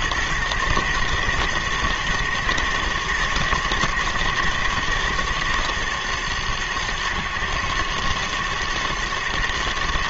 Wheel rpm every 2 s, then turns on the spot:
120, 120, 120, 110, 110.
none